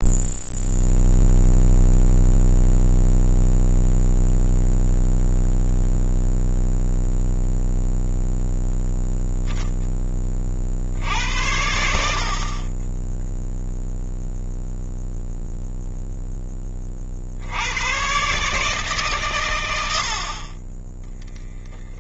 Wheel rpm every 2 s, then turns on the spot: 0, 0, 0, 0, 0, 60, 20, 0, 30, 140, 20.
none